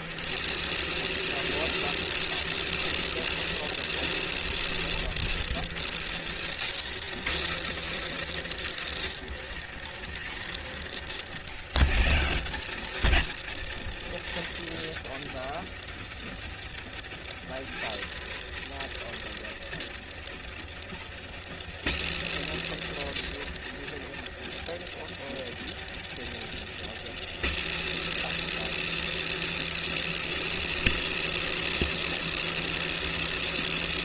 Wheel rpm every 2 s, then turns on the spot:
170, 180, 180, 160, 160, 120, 110, 110, 100, 130, 100, 150, 110, 110, 170, 180, 180.
none